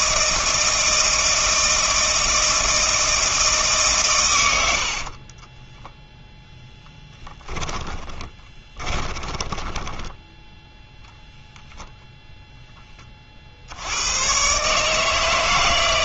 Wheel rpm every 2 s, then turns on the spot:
160, 160, 70, 10, 30, 10, 10, 140.
6-10